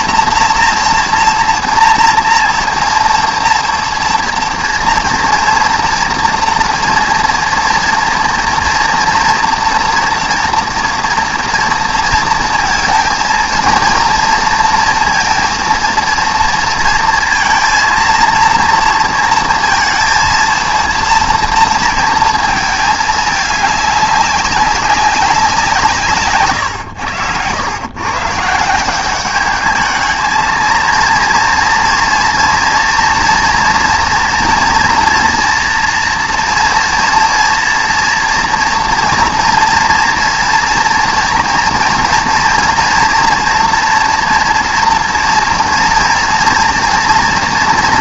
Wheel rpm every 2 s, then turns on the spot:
240, 230, 230, 230, 230, 230, 230, 230, 230, 230, 230, 220, 190, 130, 170, 230, 230, 230, 230, 230, 230, 230, 230, 230.
none